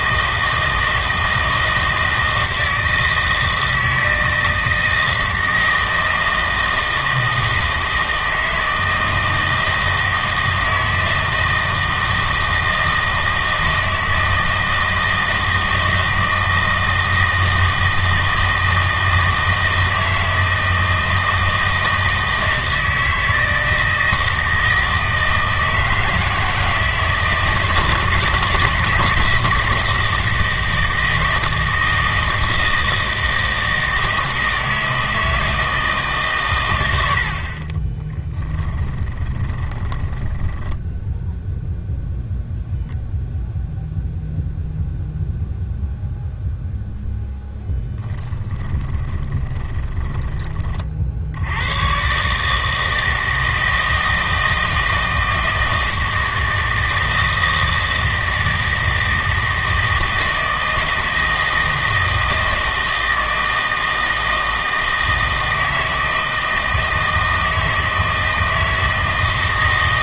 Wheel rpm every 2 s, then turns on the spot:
160, 160, 160, 160, 160, 160, 160, 160, 160, 160, 160, 160, 160, 160, 160, 160, 160, 160, 100, 20, 10, 0, 0, 0, 10, 40, 160, 160, 160, 160, 160, 160, 160, 160, 160.
38-42 48-50